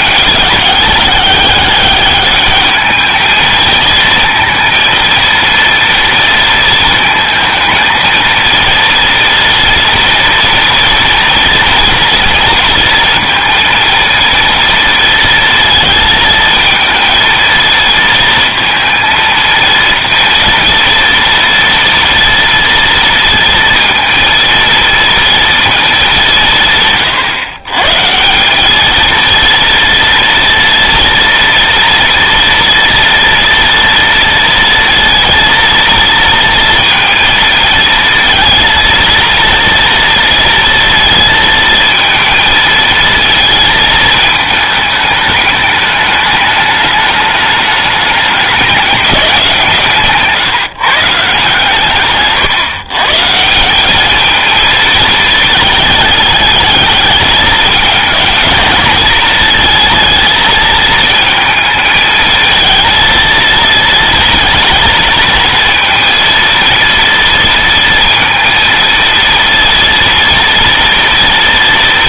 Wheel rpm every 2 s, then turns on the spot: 200, 210, 230, 230, 230, 240, 230, 230, 220, 230, 240, 230, 230, 150, 200, 230, 230, 230, 230, 230, 230, 220, 220, 210, 210, 150, 130, 220, 210, 210, 220, 230, 230, 230, 230, 230.
none